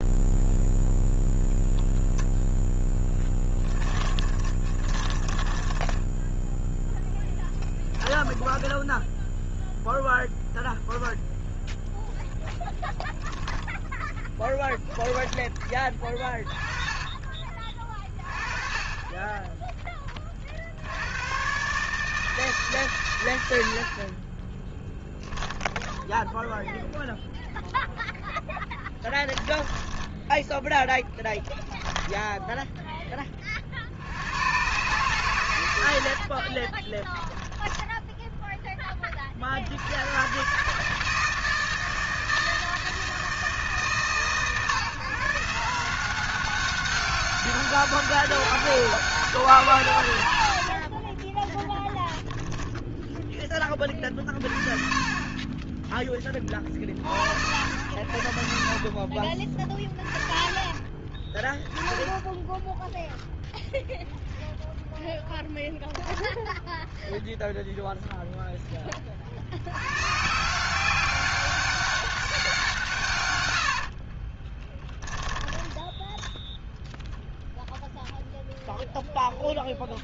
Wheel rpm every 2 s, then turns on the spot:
0, 0, 20, 0, 10, 0, 0, 10, 20, 30, 60, 140, 10, 0, 20, 10, 10, 120, 30, 20, 150, 160, 140, 190, 200, 40, 10, 20, 60, 40, 20, 0, 0, 0, 20, 190, 160, 10, 0, 0.
4-6 8-10 14-18 28-30 36-38 50-52 58-60 74-76